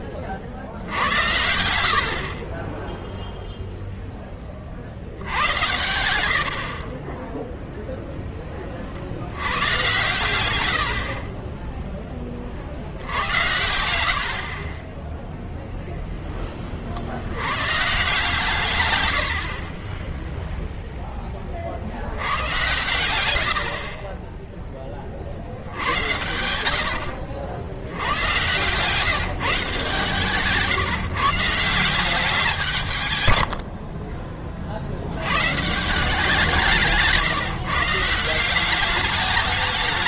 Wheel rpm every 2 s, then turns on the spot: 30, 40, 30, 70, 20, 100, 40, 40, 10, 150, 0, 110, 20, 80, 130, 150, 170, 50, 160, 170.
14-16 36-38